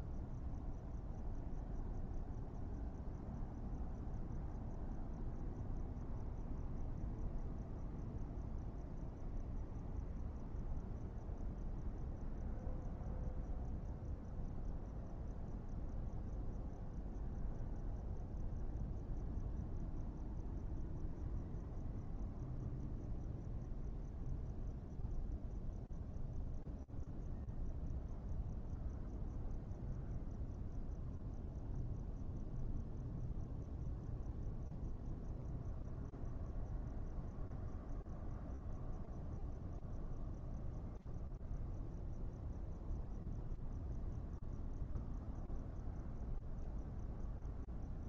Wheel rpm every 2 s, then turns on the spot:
0, 0, 0, 0, 0, 0, 0, 0, 0, 0, 0, 0, 0, 0, 0, 0, 0, 0, 0, 0, 0, 0, 0, 0.
none